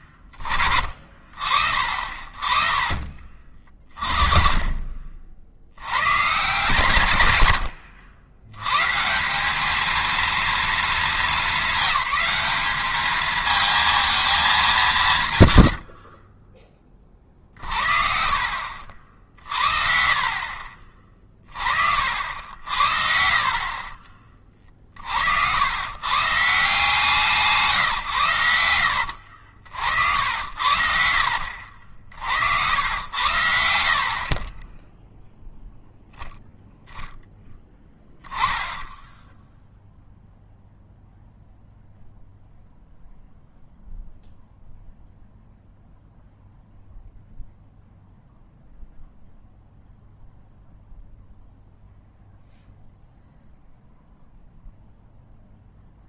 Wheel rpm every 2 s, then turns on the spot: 40, 30, 30, 140, 110, 230, 200, 210, 30, 60, 40, 70, 30, 150, 90, 80, 80, 30, 0, 20, 0, 0, 0, 0, 0, 0, 0, 0.
2-6 16-18 22-24